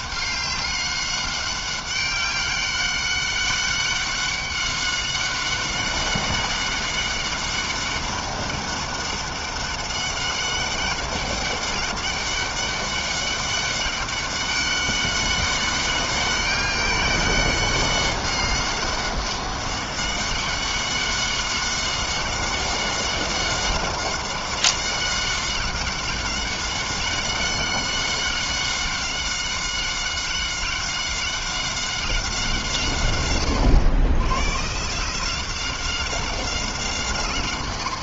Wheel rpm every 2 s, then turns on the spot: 200, 200, 190, 190, 200, 200, 200, 200, 200, 200, 200, 190, 190, 190, 190, 190, 180, 120, 180.
none